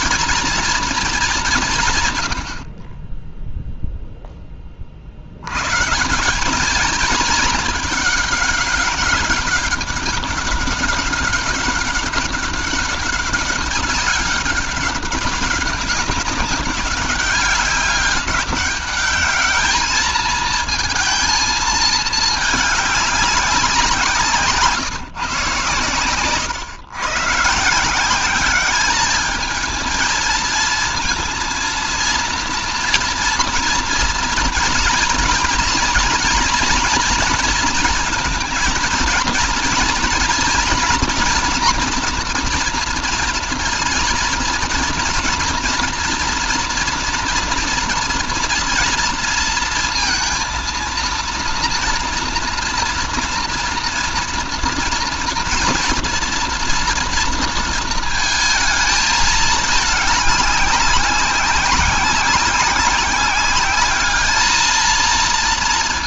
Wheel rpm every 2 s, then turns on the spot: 230, 50, 40, 210, 200, 200, 200, 190, 190, 200, 220, 210, 150, 140, 210, 230, 230, 230, 230, 230, 240, 240, 230, 230, 230, 230, 230, 230, 230, 220, 200, 190, 220.
none